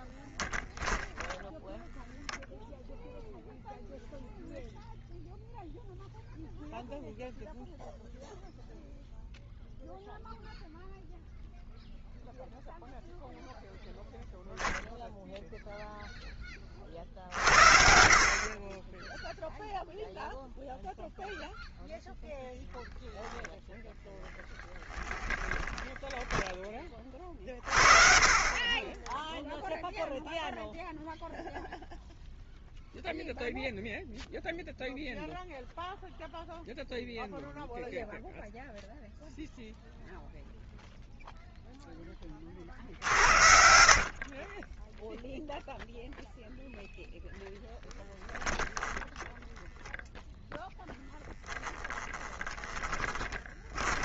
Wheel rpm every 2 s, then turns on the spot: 0, 0, 0, 0, 0, 0, 0, 0, 30, 20, 0, 0, 10, 20, 20, 0, 0, 0, 0, 0, 0, 50, 10, 0, 10, 0, 10.
24-26 28-30 42-46 48-50 52-54